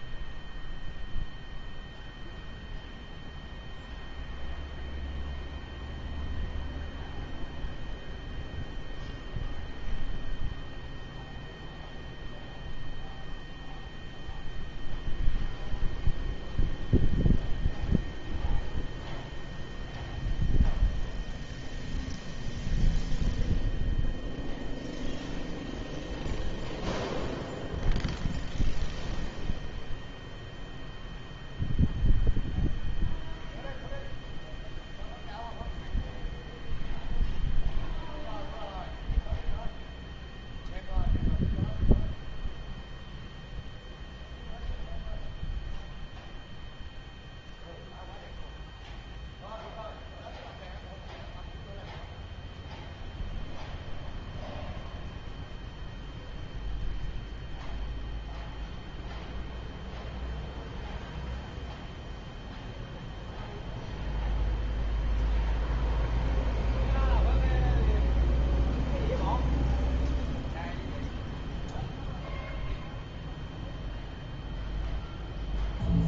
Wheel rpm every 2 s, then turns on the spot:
0, 0, 0, 0, 0, 0, 0, 0, 0, 0, 0, 0, 0, 0, 0, 0, 0, 0, 0, 0, 0, 0, 0, 0, 0, 0, 0, 0, 0, 0, 0, 0, 0, 0, 0, 0, 0, 0.
none